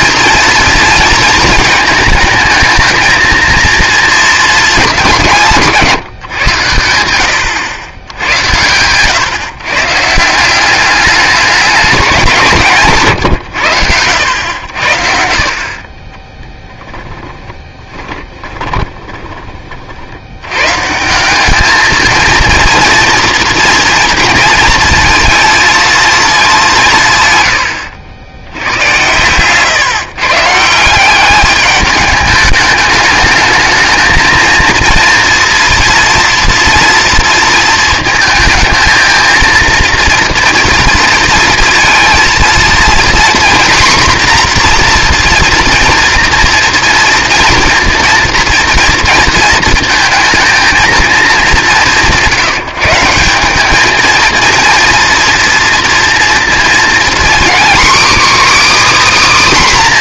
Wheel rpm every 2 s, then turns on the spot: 230, 220, 200, 110, 110, 180, 160, 80, 20, 20, 130, 230, 230, 200, 100, 160, 210, 230, 230, 230, 230, 230, 250, 230, 230, 220, 160, 230, 230, 300.
16-20